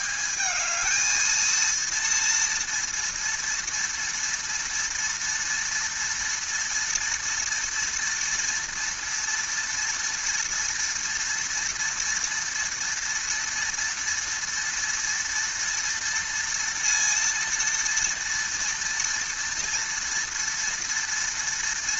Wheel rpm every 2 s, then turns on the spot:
210, 230, 230, 230, 230, 230, 230, 230, 230, 230, 230.
none